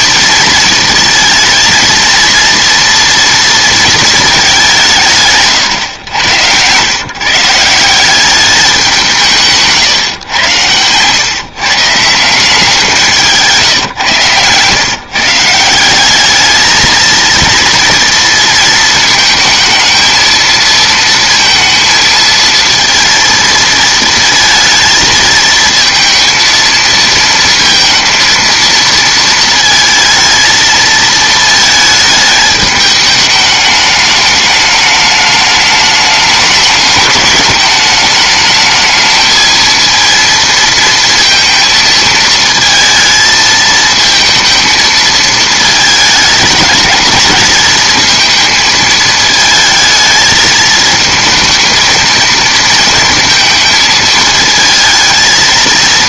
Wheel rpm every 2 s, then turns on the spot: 220, 230, 190, 110, 190, 110, 170, 130, 220, 230, 220, 230, 230, 230, 230, 220, 210, 210, 210, 220, 230, 220, 230, 220, 220, 220, 230, 220.
none